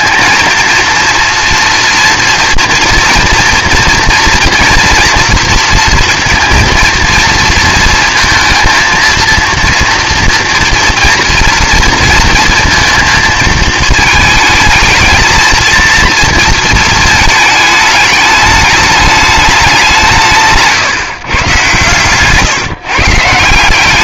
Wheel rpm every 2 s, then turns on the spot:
230, 230, 230, 230, 220, 230, 230, 220, 230, 210, 150, 150.
none